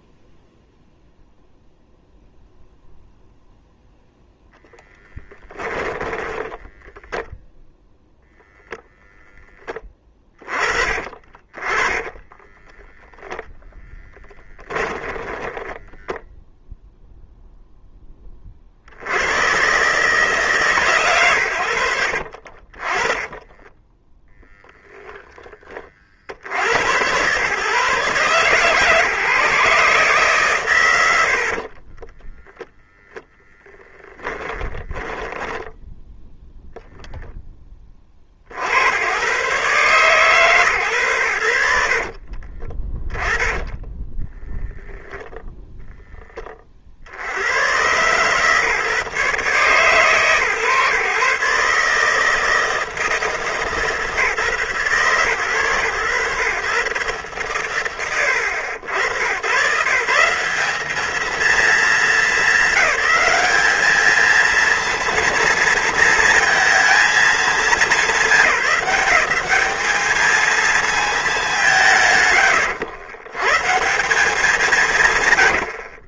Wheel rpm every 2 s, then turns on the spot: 0, 0, 0, 10, 0, 30, 10, 10, 0, 50, 150, 40, 0, 70, 140, 110, 0, 10, 0, 80, 140, 50, 0, 30, 130, 140, 160, 130, 130, 90, 170, 220, 230, 220, 210, 220, 130, 180.
6-8 12-16 22-24 34-36 42-44